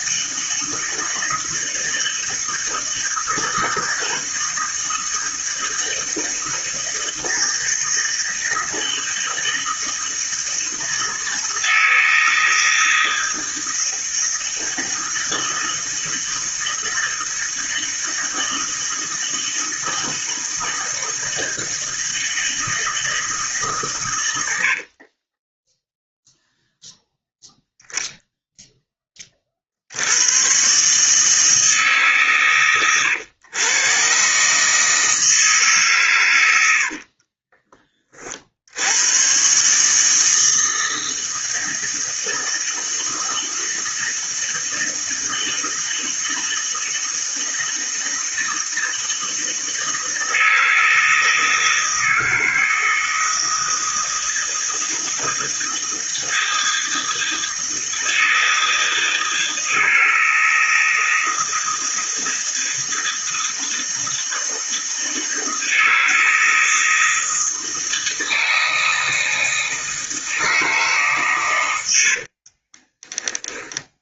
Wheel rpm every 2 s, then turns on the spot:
160, 160, 160, 160, 160, 160, 160, 160, 160, 160, 160, 160, 70, 0, 10, 140, 120, 150, 90, 70, 160, 160, 160, 160, 160, 160, 160, 160, 160, 160, 160, 160, 160, 160, 160, 160, 30.
24-26 36-38 72-74